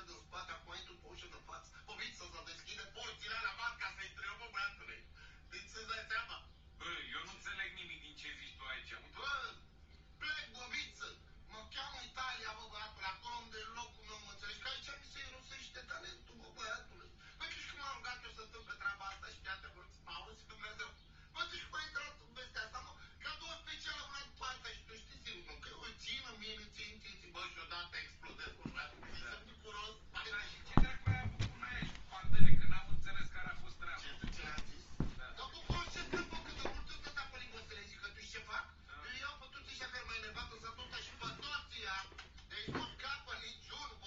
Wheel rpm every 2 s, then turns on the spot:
0, 0, 0, 0, 0, 0, 0, 0, 0, 0, 0, 0, 0, 0, 0, 0, 0, 0, 0, 0, 0, 0.
none